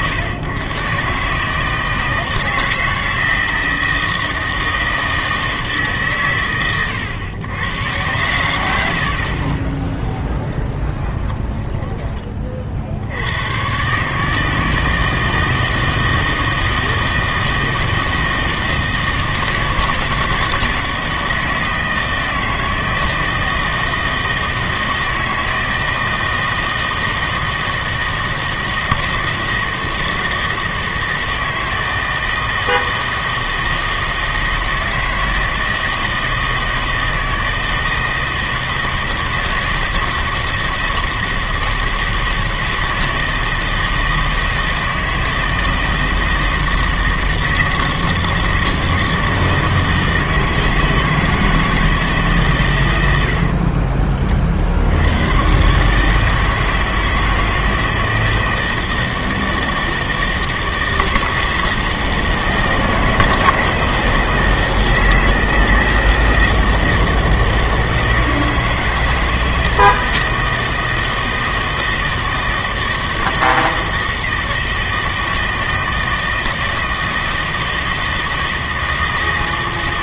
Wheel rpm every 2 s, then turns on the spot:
130, 160, 160, 120, 100, 10, 30, 160, 160, 160, 160, 160, 160, 160, 160, 160, 160, 160, 160, 160, 160, 160, 160, 160, 160, 160, 110, 60, 160, 160, 160, 160, 170, 160, 160, 160, 160, 160, 160, 160.
10-12